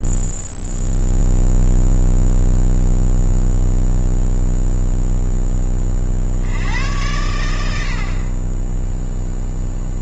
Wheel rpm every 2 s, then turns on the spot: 0, 0, 0, 90, 10.
none